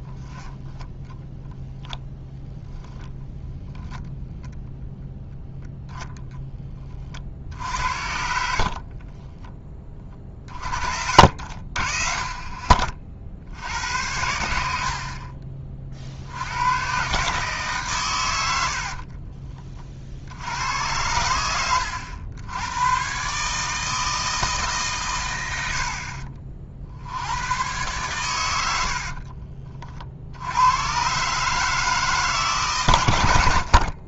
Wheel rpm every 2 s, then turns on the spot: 10, 10, 0, 20, 40, 40, 40, 80, 100, 90, 80, 100, 150, 50, 80, 90, 130.
8-10 18-20